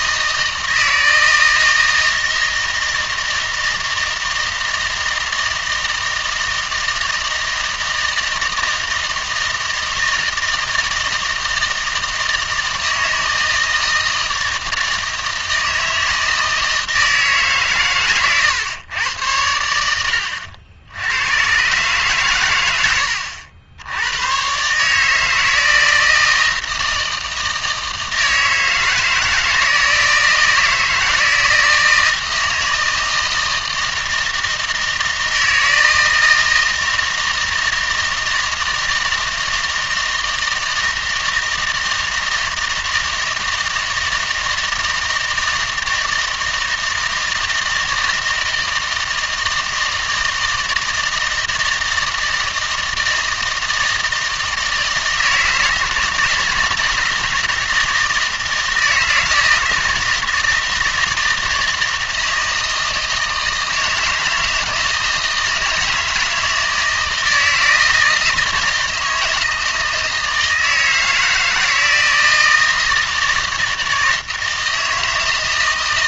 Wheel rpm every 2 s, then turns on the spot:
160, 160, 160, 160, 160, 160, 160, 160, 160, 120, 70, 100, 130, 160, 160, 160, 160, 160, 160, 160, 160, 160, 160, 160, 160, 160, 160, 160, 160, 160, 160, 160, 160, 160, 160, 160, 160, 160.
none